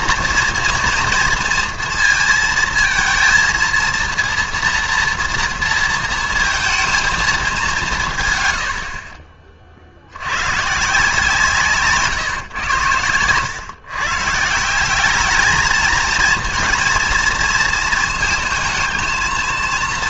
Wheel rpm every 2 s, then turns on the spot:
240, 230, 230, 230, 80, 130, 120, 170, 230, 220.
none